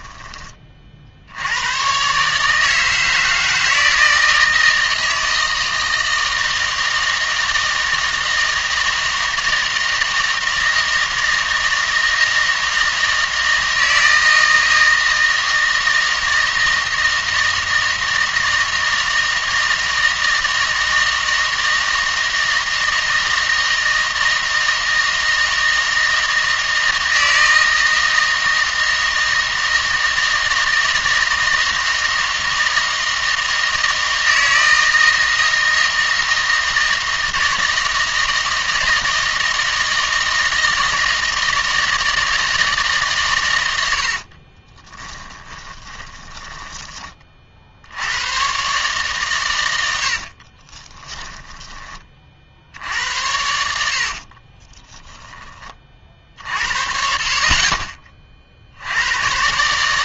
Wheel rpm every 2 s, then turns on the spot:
30, 150, 160, 160, 160, 160, 160, 160, 160, 160, 160, 160, 160, 160, 160, 160, 160, 160, 160, 160, 160, 160, 30, 10, 130, 40, 60, 20, 50, 60.
44-48 50-52 54-56